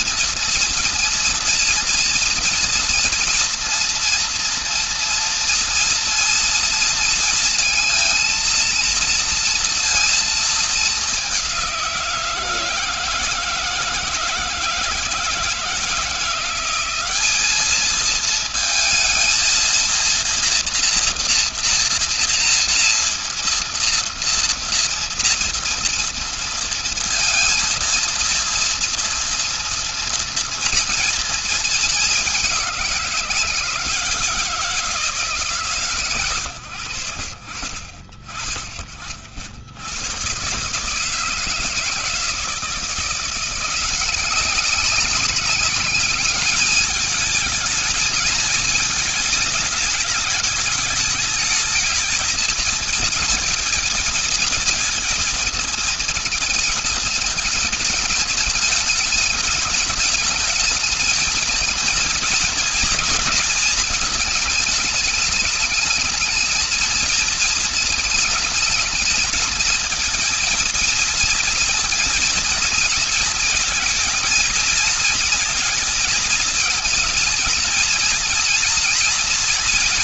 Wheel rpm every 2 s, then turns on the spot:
230, 230, 230, 230, 230, 220, 170, 160, 180, 220, 230, 230, 230, 230, 230, 230, 200, 170, 110, 40, 130, 160, 190, 200, 220, 210, 220, 230, 230, 220, 220, 230, 230, 220, 220, 230, 230, 230, 230, 230.
none